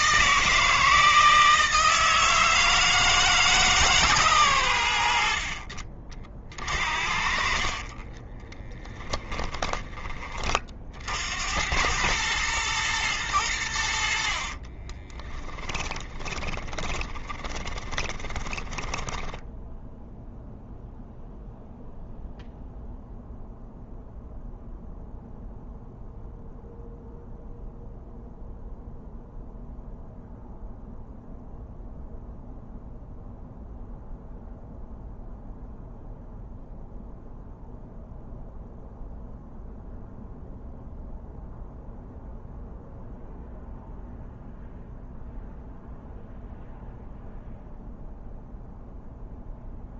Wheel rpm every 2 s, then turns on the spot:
160, 160, 100, 40, 10, 40, 110, 60, 30, 10, 0, 0, 0, 0, 0, 0, 0, 0, 0, 0, 0, 0, 0, 0, 0.
6-10 14-20